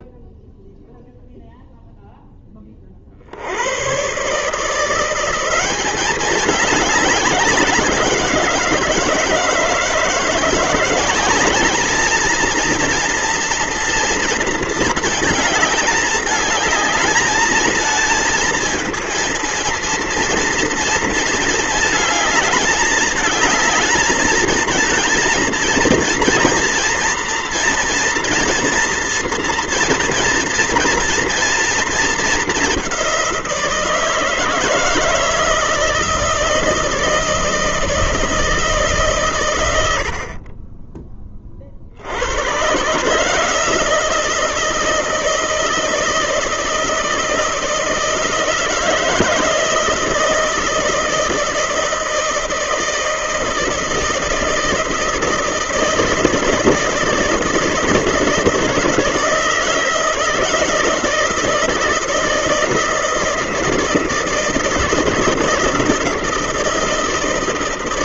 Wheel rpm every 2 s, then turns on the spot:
0, 30, 160, 200, 160, 180, 230, 230, 210, 230, 230, 210, 220, 230, 230, 230, 200, 160, 160, 160, 30, 130, 160, 160, 160, 160, 160, 160, 160, 160, 160, 160, 160, 170.
none